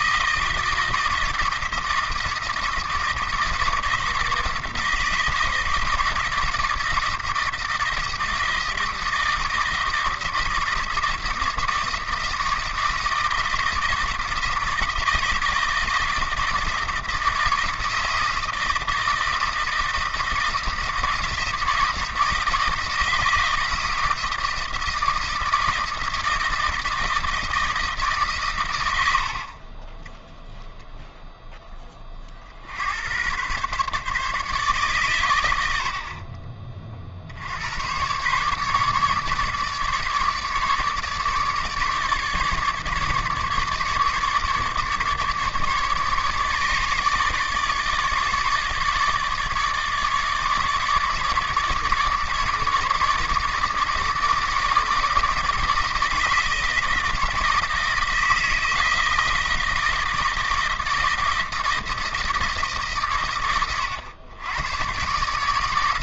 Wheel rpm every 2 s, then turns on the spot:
160, 160, 160, 160, 160, 170, 160, 160, 160, 160, 160, 160, 160, 160, 110, 0, 70, 140, 40, 140, 150, 150, 150, 150, 150, 150, 150, 150, 160, 160, 160, 150, 110.
none